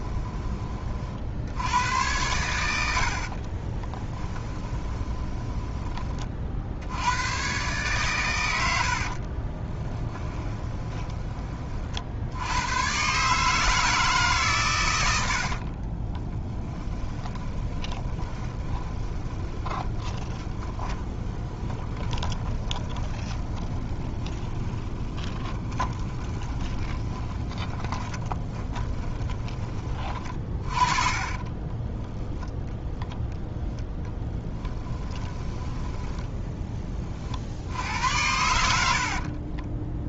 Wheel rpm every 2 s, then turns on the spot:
20, 80, 10, 60, 90, 20, 90, 130, 20, 20, 20, 20, 10, 20, 10, 30, 0, 10, 10, 70.
4-6 10-12 16-30 34-36